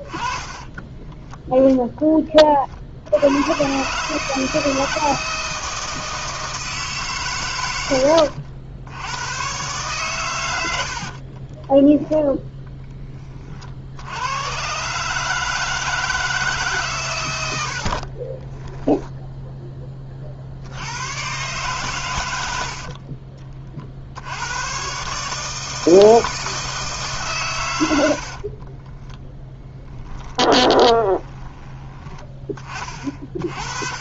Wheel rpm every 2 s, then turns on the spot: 20, 30, 150, 160, 80, 90, 10, 110, 150, 20, 60, 80, 100, 160, 40, 20, 30.
0-2 18-20 28-32